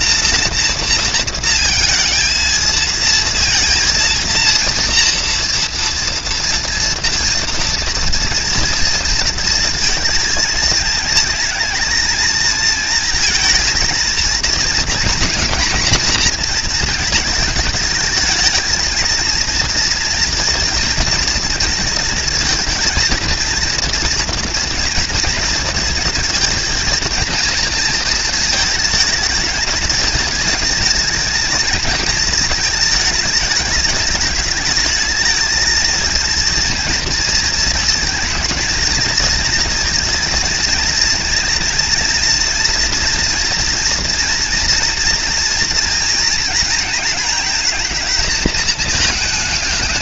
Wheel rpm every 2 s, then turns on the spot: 230, 230, 230, 230, 230, 220, 230, 230, 230, 220, 230, 230, 240, 230, 220, 220, 210, 210, 230, 220, 230, 230, 230, 230, 220.
none